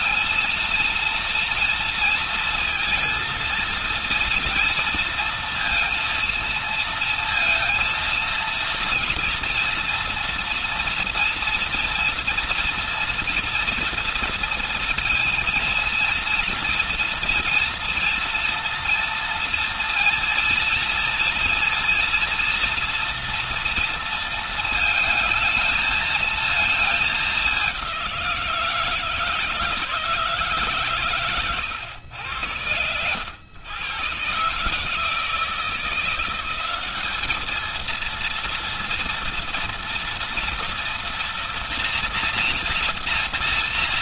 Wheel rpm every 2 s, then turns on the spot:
220, 230, 230, 230, 230, 230, 230, 230, 230, 230, 230, 240, 230, 220, 170, 160, 100, 140, 190, 230, 230, 230.
none